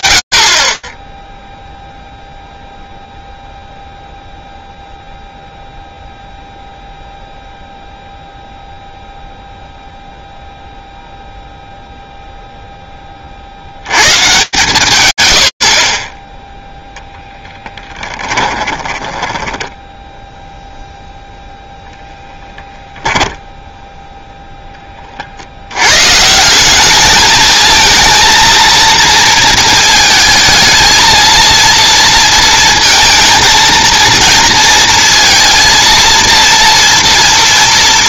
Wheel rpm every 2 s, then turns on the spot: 50, 0, 0, 0, 0, 0, 90, 50, 10, 10, 0, 10, 70, 220, 230, 230, 230, 230, 240.
16-20 22-24